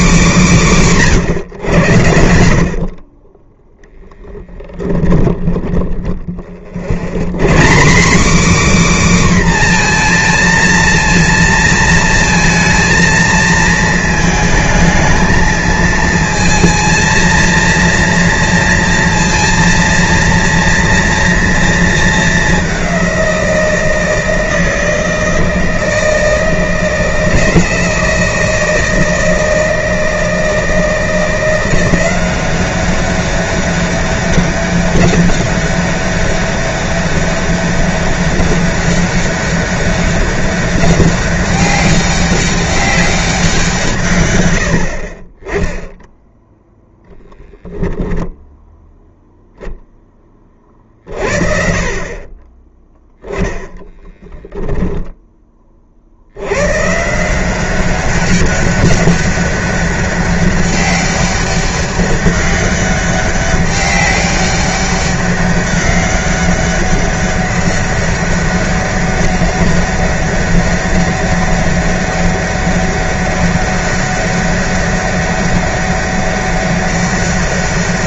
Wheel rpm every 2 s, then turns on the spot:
170, 40, 10, 70, 280, 230, 230, 220, 230, 230, 230, 190, 160, 160, 160, 170, 200, 200, 200, 200, 200, 200, 60, 10, 10, 30, 30, 10, 110, 200, 200, 200, 200, 200, 200, 200, 200, 200, 200.
4-6 54-56